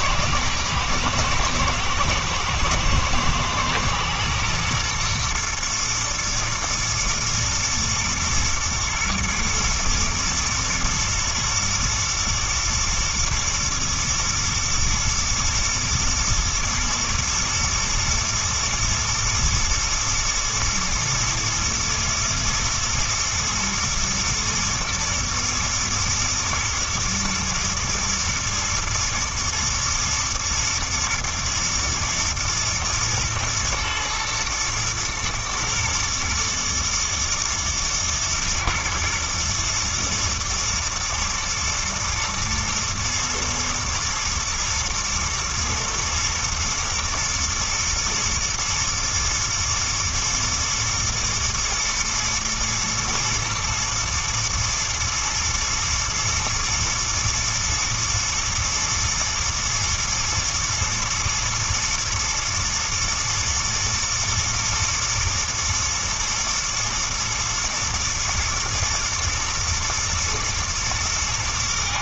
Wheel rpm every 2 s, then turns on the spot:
110, 110, 120, 120, 110, 120, 110, 110, 120, 110, 120, 120, 110, 110, 120, 110, 110, 110, 120, 110, 120, 110, 110, 110, 120, 120, 110, 110, 110, 110, 120, 110, 110, 110, 110, 110.
none